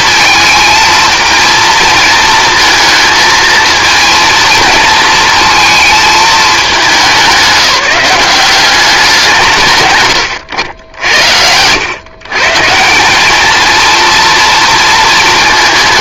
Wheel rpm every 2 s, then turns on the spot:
220, 220, 230, 190, 190, 80, 170, 230.
none